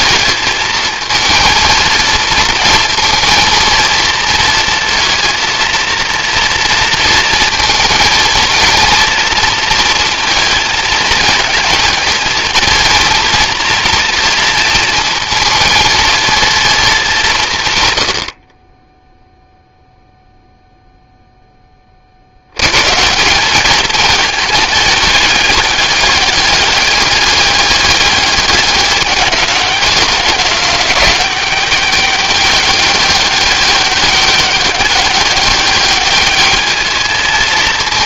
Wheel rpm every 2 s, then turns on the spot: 220, 220, 230, 230, 230, 220, 230, 230, 210, 10, 0, 90, 210, 200, 200, 200, 200, 200, 210.
none